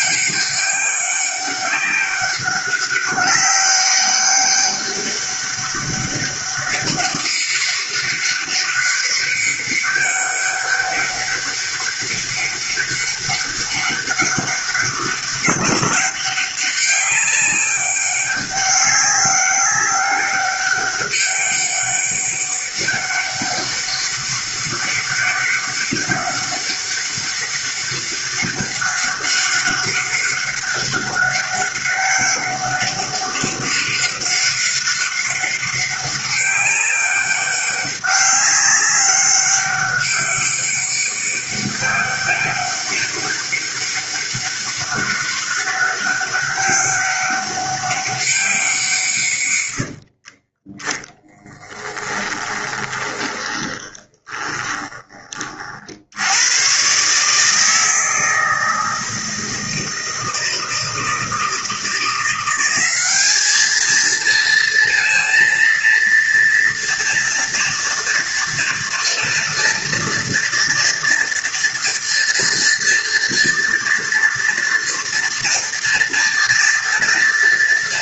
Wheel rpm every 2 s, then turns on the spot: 200, 200, 200, 200, 200, 200, 200, 200, 190, 200, 200, 190, 190, 200, 200, 200, 200, 200, 200, 200, 200, 200, 200, 200, 180, 20, 20, 20, 120, 160, 170, 190, 230, 230, 230, 230, 230, 230, 230.
50-56